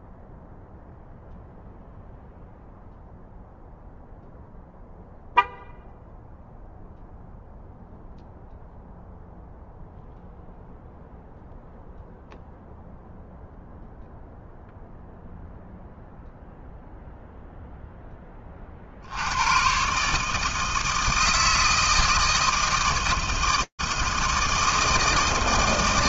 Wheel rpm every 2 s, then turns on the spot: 0, 0, 0, 0, 0, 0, 0, 0, 0, 30, 150, 160, 160.
none